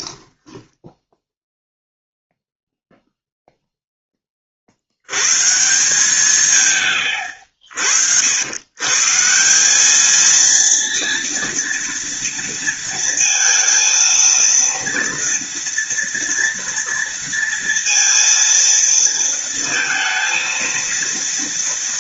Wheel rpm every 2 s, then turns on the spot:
10, 0, 90, 110, 130, 230, 230, 230, 230, 230, 230.
0-2